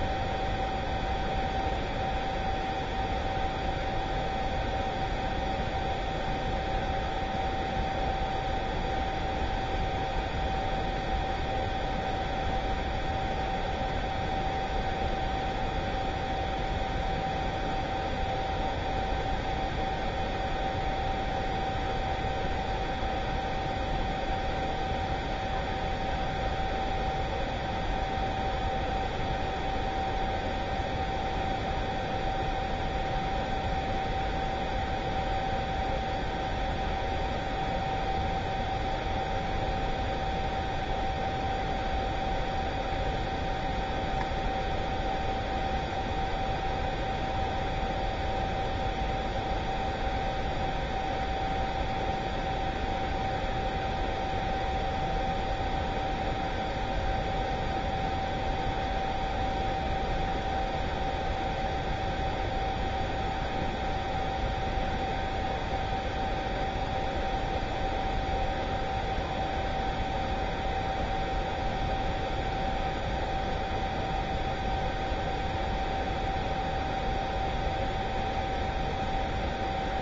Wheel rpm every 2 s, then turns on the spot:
0, 0, 0, 0, 0, 0, 0, 0, 0, 0, 0, 0, 0, 0, 0, 0, 0, 0, 0, 0, 0, 0, 0, 0, 0, 0, 0, 0, 0, 0, 0, 0, 0, 0, 0, 0, 0, 0, 0, 0.
none